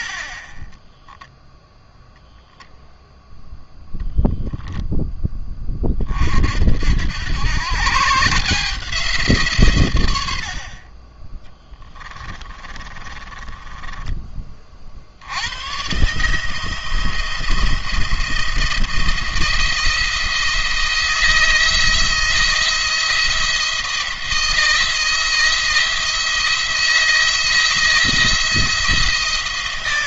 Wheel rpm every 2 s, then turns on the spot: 40, 0, 0, 70, 170, 60, 30, 40, 150, 170, 160, 170, 170, 170, 160.
0-2 12-14